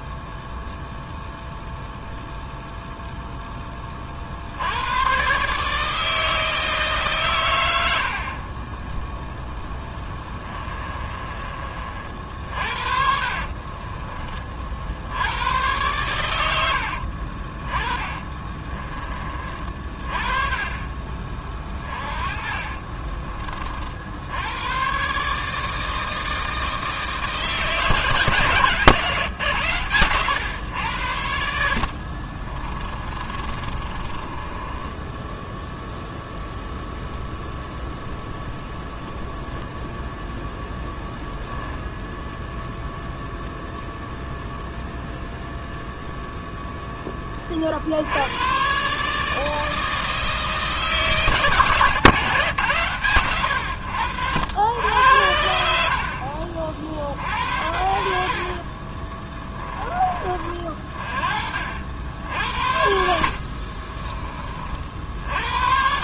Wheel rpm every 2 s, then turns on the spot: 0, 0, 110, 140, 0, 20, 50, 70, 70, 30, 30, 30, 140, 150, 130, 90, 20, 10, 0, 0, 0, 0, 0, 10, 140, 160, 130, 90, 60, 30, 40, 70, 60.
10-14 16-18 22-24 32-36 58-60 62-64